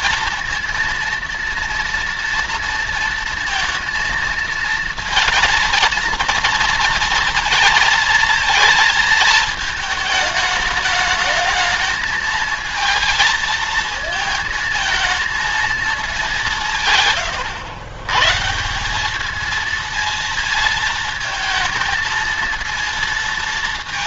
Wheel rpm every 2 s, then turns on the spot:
230, 230, 230, 230, 220, 220, 220, 220, 130, 210, 220, 230.
none